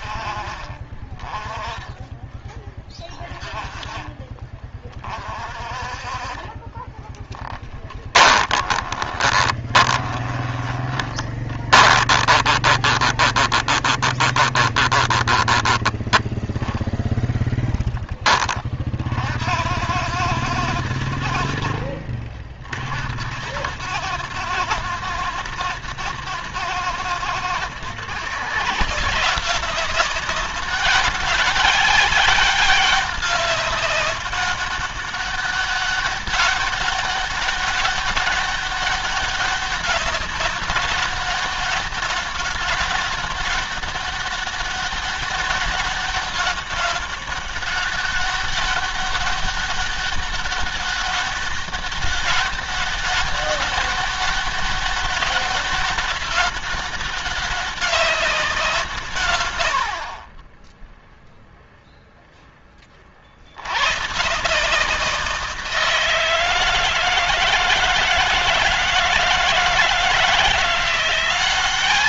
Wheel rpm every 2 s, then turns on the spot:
40, 20, 30, 20, 30, 20, 20, 20, 10, 30, 90, 50, 110, 110, 140, 200, 200, 200, 190, 200, 200, 190, 200, 200, 200, 200, 200, 200, 200, 180, 10, 10, 160, 160, 160, 170.
6-16